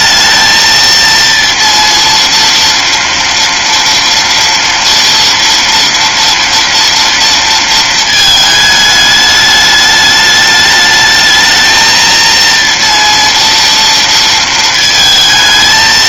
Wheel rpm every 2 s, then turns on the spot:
220, 230, 230, 230, 220, 210, 230, 230.
none